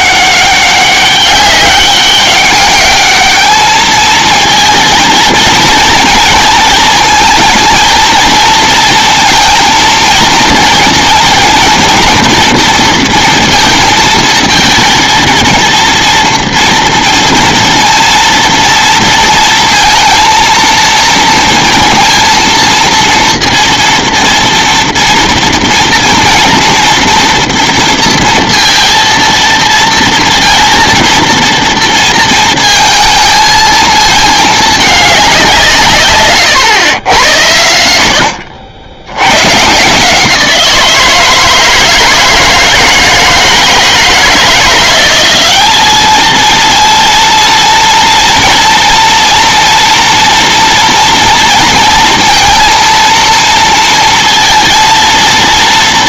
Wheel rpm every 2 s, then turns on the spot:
190, 200, 220, 230, 220, 230, 230, 220, 230, 230, 230, 230, 230, 230, 230, 230, 220, 220, 120, 70, 160, 160, 170, 220, 230, 230, 230, 230.
none